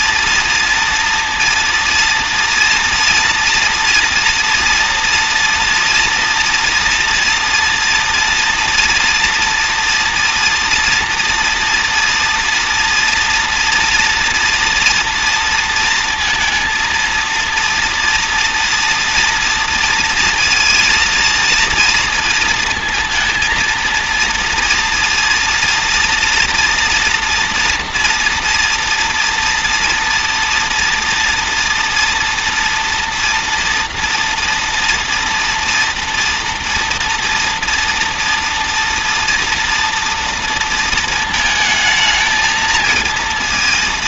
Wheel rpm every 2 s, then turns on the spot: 230, 230, 230, 230, 230, 230, 230, 230, 230, 230, 230, 230, 240, 240, 230, 230, 240, 230, 230, 230, 230, 220.
none